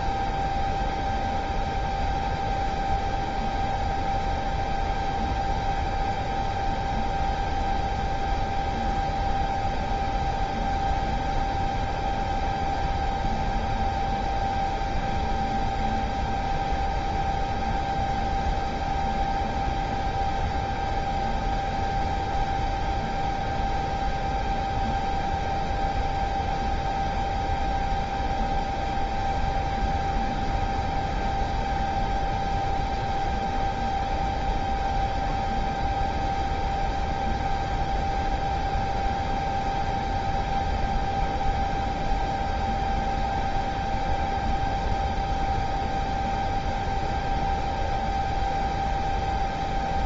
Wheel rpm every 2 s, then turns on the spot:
0, 0, 0, 0, 0, 0, 0, 0, 0, 0, 0, 0, 0, 0, 0, 0, 0, 0, 0, 0, 0, 0, 0, 0, 0.
none